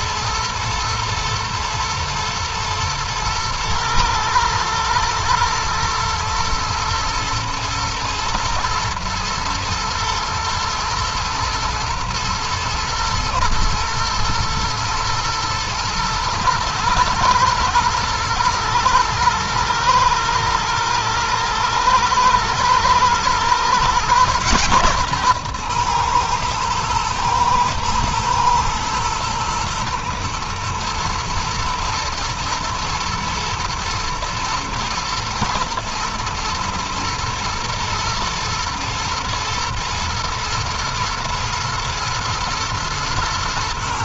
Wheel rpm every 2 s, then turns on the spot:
120, 110, 120, 120, 120, 110, 110, 110, 110, 110, 110, 110, 130, 120, 110, 110, 120, 120, 110, 120, 110, 120.
none